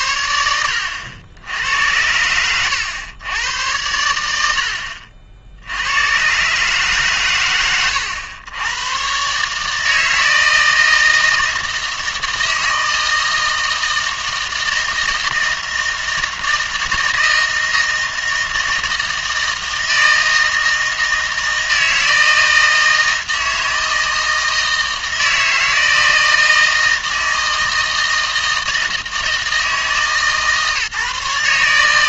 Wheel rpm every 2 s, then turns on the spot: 80, 100, 70, 140, 100, 160, 160, 160, 160, 160, 160, 160, 160, 160, 160, 150.
none